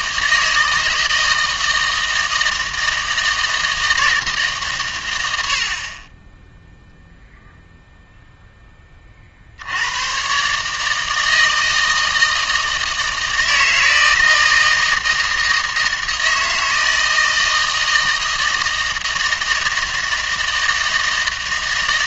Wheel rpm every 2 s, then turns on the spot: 160, 160, 140, 0, 10, 150, 160, 160, 160, 160, 160.
none